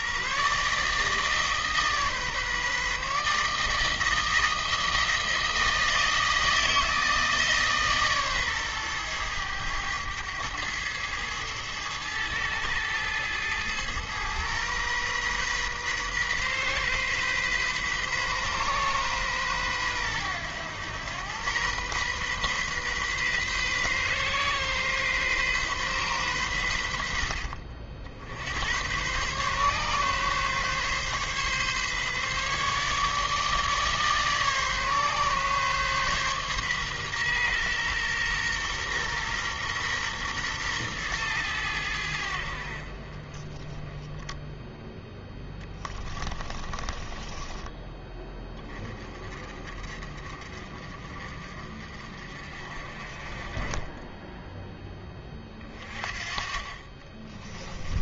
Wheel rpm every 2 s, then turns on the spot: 150, 140, 160, 160, 120, 110, 110, 120, 130, 130, 100, 130, 130, 100, 90, 130, 140, 140, 130, 120, 120, 50, 0, 20, 30, 50, 40, 10, 30.
46-48 56-58